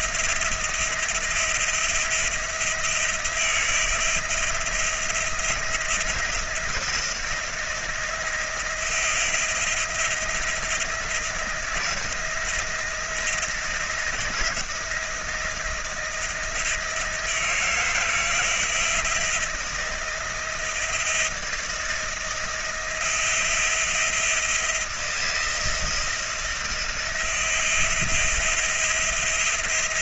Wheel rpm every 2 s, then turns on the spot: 170, 170, 170, 170, 170, 170, 170, 160, 170, 160, 170, 170, 170, 170, 170.
none